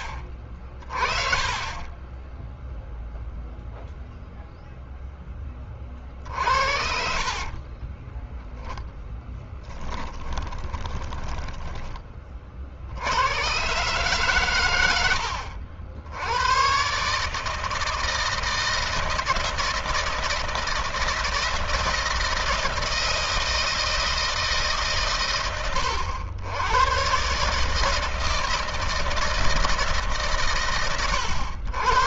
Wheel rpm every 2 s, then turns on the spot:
30, 0, 0, 50, 10, 10, 60, 110, 120, 160, 160, 160, 140, 110, 160, 110.
6-8 10-12